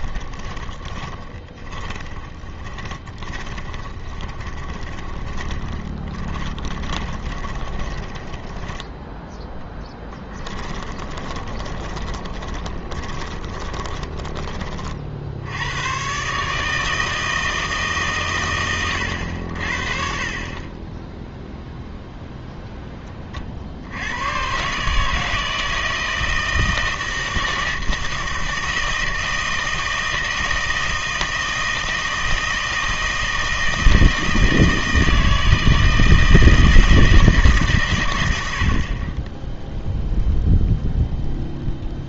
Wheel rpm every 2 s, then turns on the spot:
20, 20, 20, 20, 10, 20, 20, 40, 160, 100, 20, 10, 140, 160, 160, 160, 160, 160, 160, 80, 0.
0-14